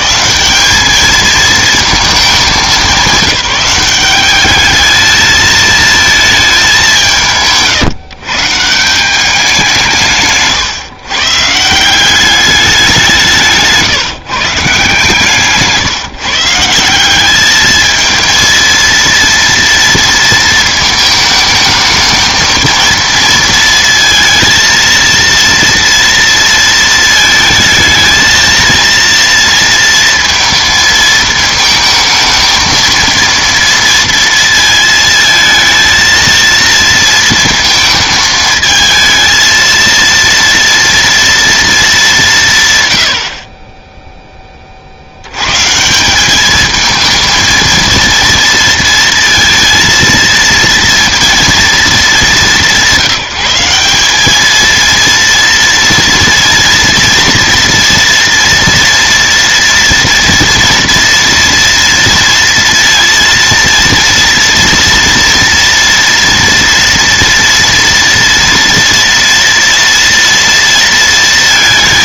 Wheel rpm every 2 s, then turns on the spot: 190, 200, 210, 190, 160, 130, 200, 160, 170, 230, 220, 220, 230, 230, 230, 230, 230, 230, 230, 220, 230, 130, 30, 220, 230, 230, 200, 220, 230, 240, 240, 230, 230, 230, 230, 230.
none